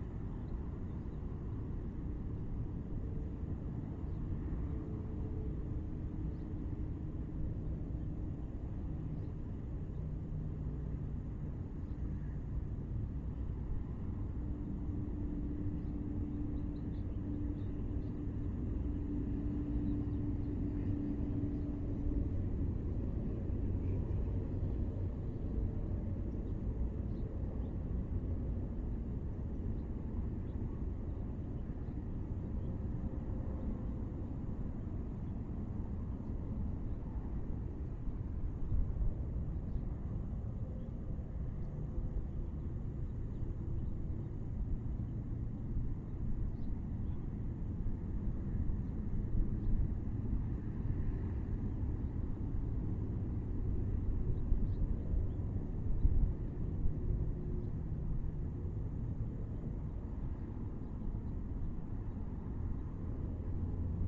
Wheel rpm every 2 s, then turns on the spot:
0, 0, 0, 0, 0, 0, 0, 0, 0, 0, 0, 0, 0, 0, 0, 0, 0, 0, 0, 0, 0, 0, 0, 0, 0, 0, 0, 0, 0, 0, 0, 0.
none